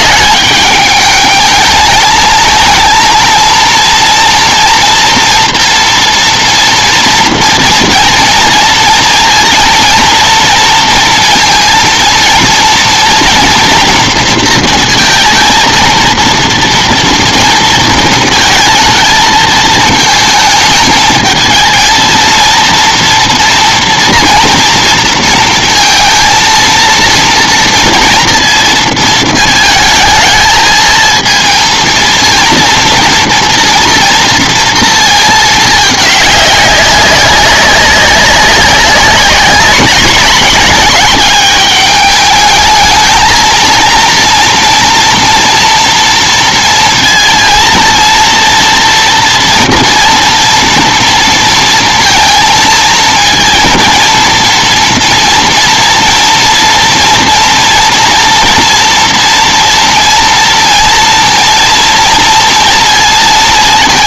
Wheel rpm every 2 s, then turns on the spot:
210, 230, 230, 230, 230, 230, 230, 230, 230, 220, 220, 230, 230, 230, 230, 220, 230, 220, 190, 200, 200, 220, 230, 230, 230, 230, 220, 230, 230, 230, 230, 230.
none